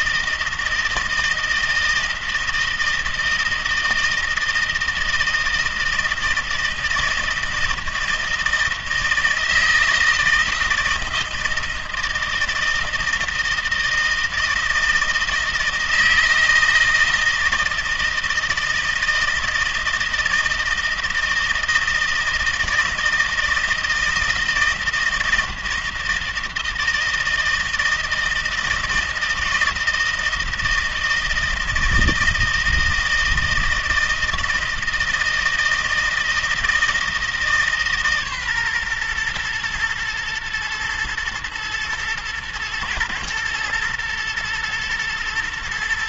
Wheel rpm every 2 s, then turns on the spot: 160, 160, 160, 160, 160, 160, 160, 160, 160, 160, 160, 160, 160, 160, 160, 160, 160, 160, 160, 140, 120, 120, 110.
none